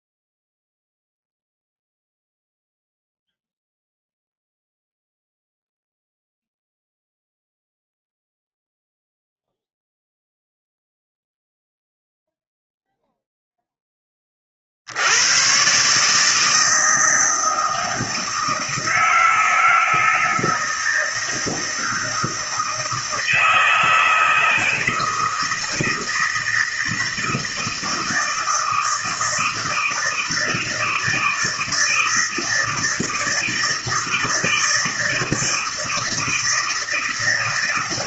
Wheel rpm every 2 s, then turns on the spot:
0, 0, 0, 0, 0, 0, 0, 40, 160, 160, 160, 160, 160, 160, 160, 160, 170, 160, 160.
none